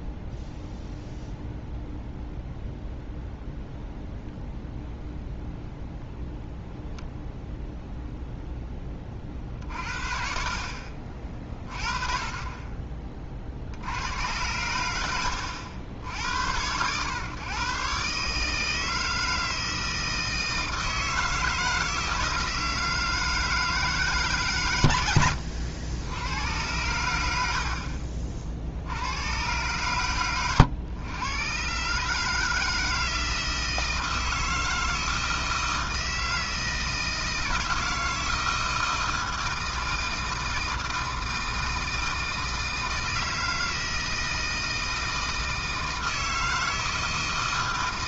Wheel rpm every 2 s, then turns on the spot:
0, 0, 0, 0, 10, 50, 30, 100, 110, 160, 160, 160, 120, 90, 60, 110, 160, 160, 160, 160, 160, 160, 160, 160.
none